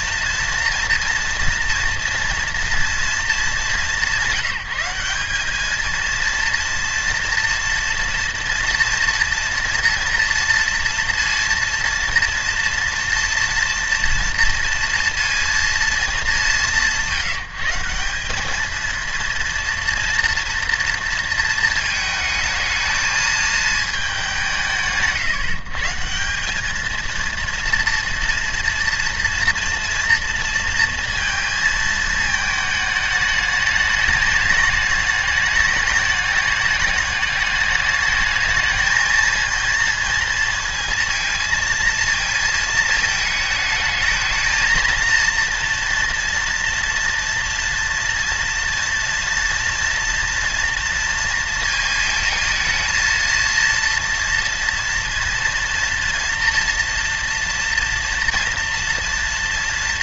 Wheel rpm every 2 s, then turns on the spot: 230, 230, 180, 230, 230, 230, 230, 230, 170, 220, 240, 220, 160, 210, 230, 230, 220, 210, 210, 220, 230, 220, 220, 230, 230, 230, 220, 230, 230, 230.
none